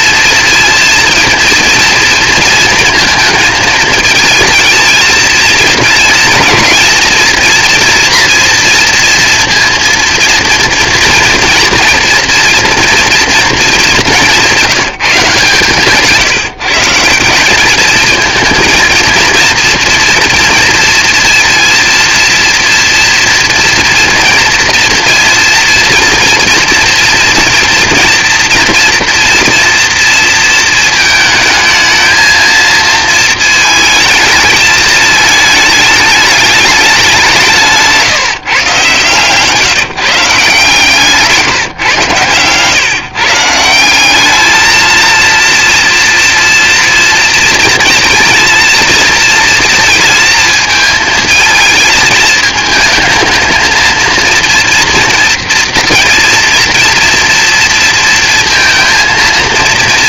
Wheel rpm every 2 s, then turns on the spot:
230, 230, 220, 230, 230, 230, 230, 160, 180, 230, 230, 230, 230, 230, 230, 220, 220, 220, 180, 150, 160, 150, 230, 230, 230, 220, 220, 230, 230, 230.
40-42